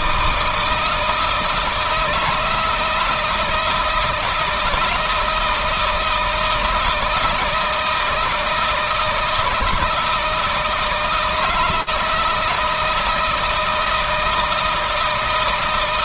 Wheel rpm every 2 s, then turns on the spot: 160, 160, 170, 160, 160, 160, 160, 160.
none